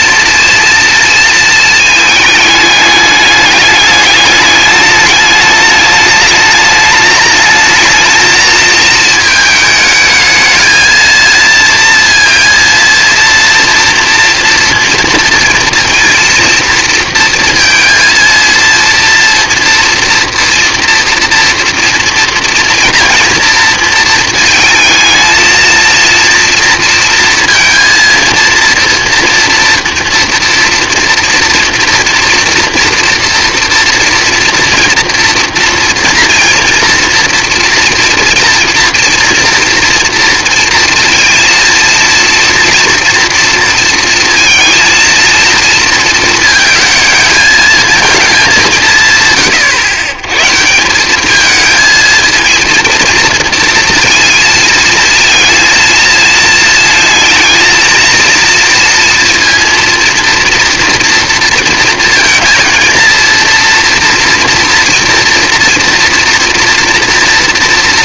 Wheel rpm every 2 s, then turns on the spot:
230, 220, 210, 210, 220, 220, 230, 240, 230, 230, 230, 230, 230, 230, 230, 240, 230, 240, 230, 230, 230, 230, 230, 230, 210, 120, 220, 230, 230, 230, 230, 230, 240, 230.
none